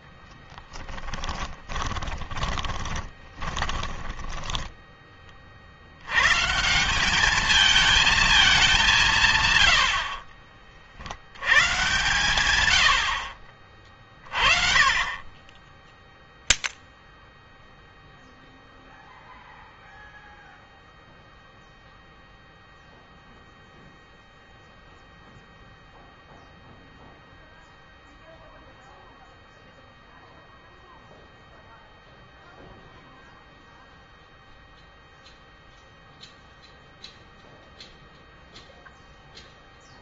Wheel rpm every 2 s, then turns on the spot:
10, 20, 20, 170, 200, 40, 90, 30, 0, 0, 0, 0, 0, 0, 0, 0, 0, 0, 0, 0.
2-6